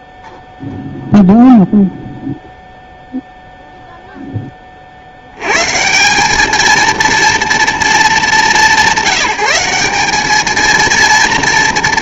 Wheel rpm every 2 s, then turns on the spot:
0, 0, 40, 230, 180, 220.
none